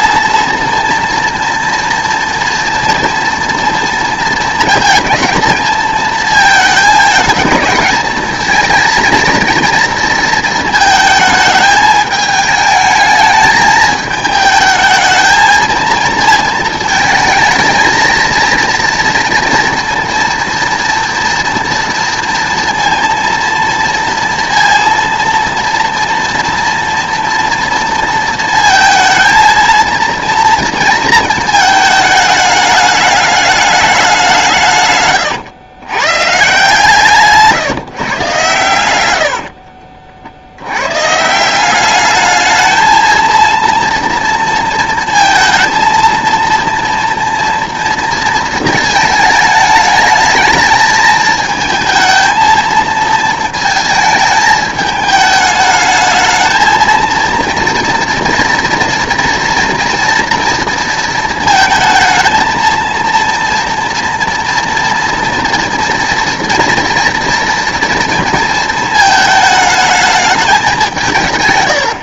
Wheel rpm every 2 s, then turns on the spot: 230, 230, 230, 220, 230, 220, 220, 220, 230, 230, 230, 230, 230, 240, 230, 230, 210, 140, 150, 100, 120, 220, 230, 230, 220, 220, 230, 220, 230, 230, 230, 230, 230, 230, 220, 190.
38-40